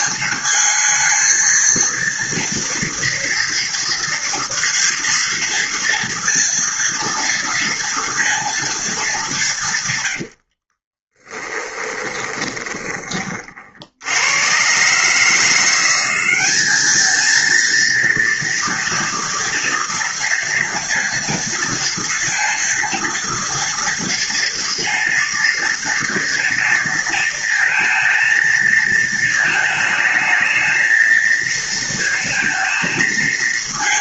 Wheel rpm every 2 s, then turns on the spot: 220, 230, 230, 230, 190, 20, 30, 140, 220, 230, 230, 230, 230, 230, 220, 230, 230.
10-12